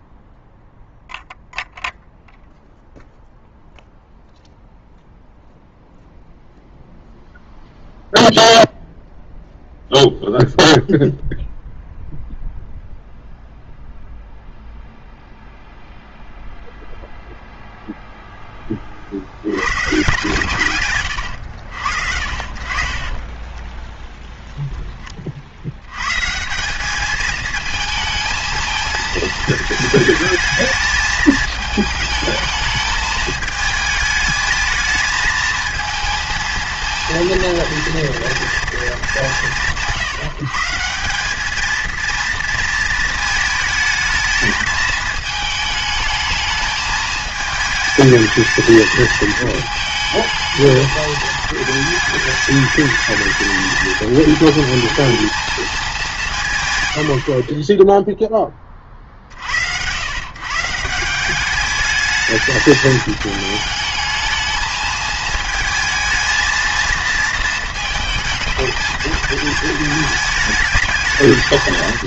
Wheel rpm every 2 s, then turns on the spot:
0, 0, 0, 0, 0, 0, 0, 0, 0, 10, 130, 50, 20, 180, 220, 220, 220, 220, 230, 230, 170, 230, 220, 210, 220, 220, 210, 220, 130, 0, 130, 210, 220, 230, 220, 210.
24-26